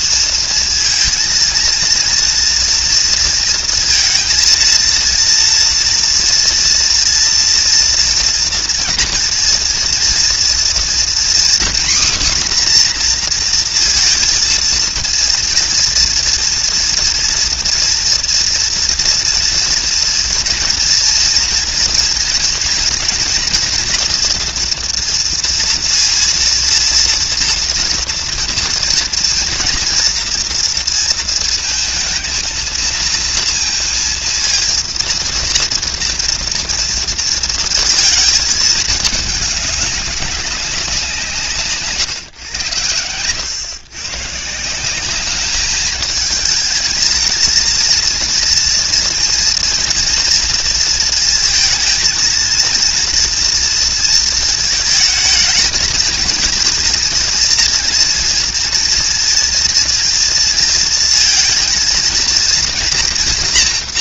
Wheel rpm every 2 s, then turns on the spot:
230, 230, 230, 230, 230, 240, 260, 230, 230, 230, 240, 230, 230, 230, 230, 230, 220, 230, 230, 220, 190, 120, 170, 210, 230, 230, 230, 230, 230, 230, 230, 230.
none